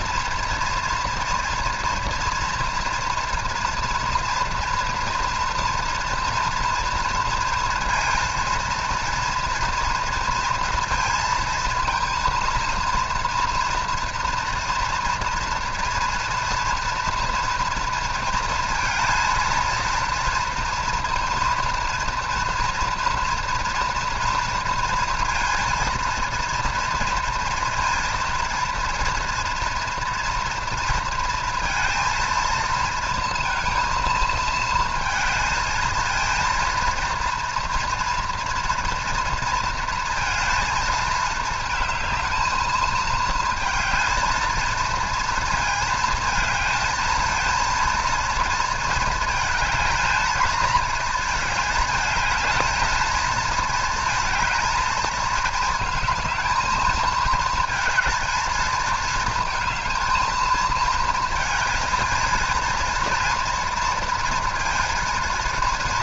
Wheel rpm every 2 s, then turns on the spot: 240, 230, 240, 230, 230, 230, 230, 230, 240, 230, 240, 230, 230, 230, 230, 230, 230, 230, 230, 230, 220, 220, 230, 230, 220, 220, 220, 220, 220, 220, 220, 230, 230.
none